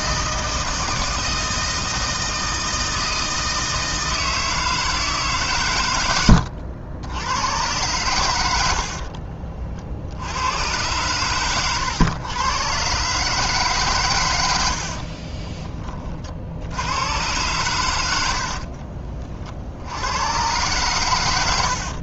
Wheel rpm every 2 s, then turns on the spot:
160, 160, 160, 80, 70, 110, 130, 60, 90, 40, 120.
8-10 14-16 18-20